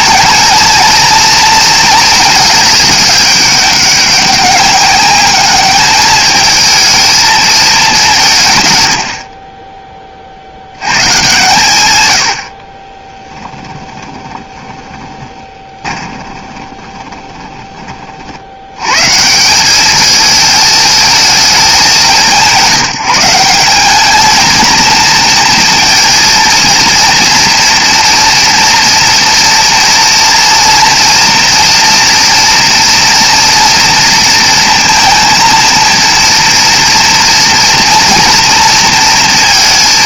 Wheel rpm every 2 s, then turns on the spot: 220, 220, 200, 220, 140, 80, 70, 10, 20, 80, 220, 180, 220, 230, 230, 230, 230, 230, 240, 230.
14-18